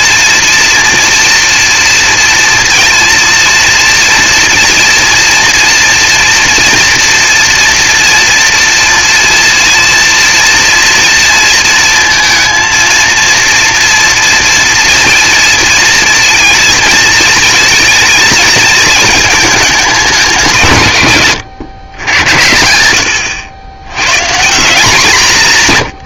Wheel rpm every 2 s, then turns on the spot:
240, 230, 240, 240, 230, 230, 230, 230, 230, 220, 170, 90, 180.
none